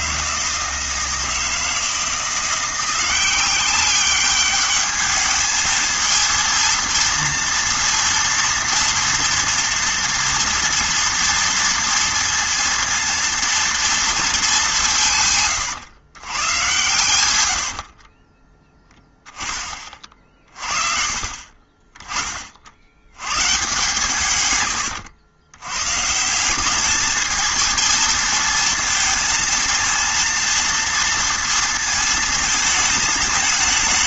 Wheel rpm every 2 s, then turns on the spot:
160, 170, 210, 230, 230, 230, 230, 210, 120, 10, 40, 50, 110, 190, 230, 230, 220.
none